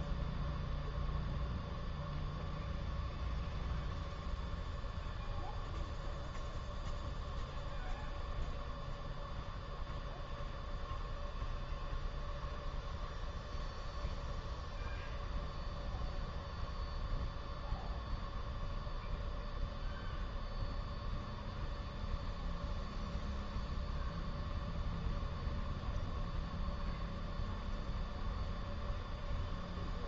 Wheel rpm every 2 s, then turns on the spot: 0, 0, 0, 0, 0, 0, 0, 0, 0, 0, 0, 0, 0, 0, 0.
none